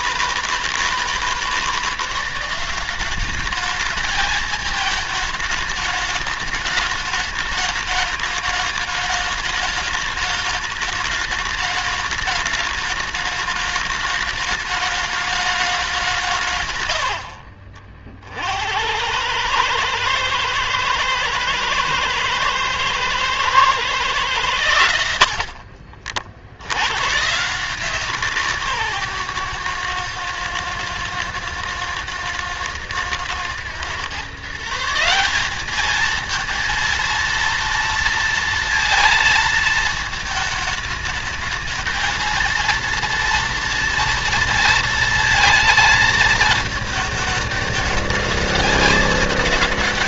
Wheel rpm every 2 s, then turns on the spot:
160, 180, 220, 210, 210, 210, 210, 210, 130, 60, 110, 110, 110, 70, 160, 120, 110, 150, 230, 230, 220, 230, 230, 220, 220.
none